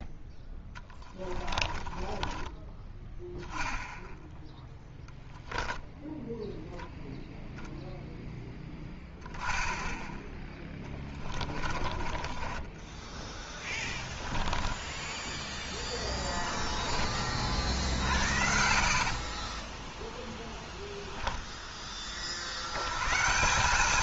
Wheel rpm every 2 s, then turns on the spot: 10, 20, 0, 0, 10, 10, 20, 10, 20, 70, 10, 70.
0-4 10-20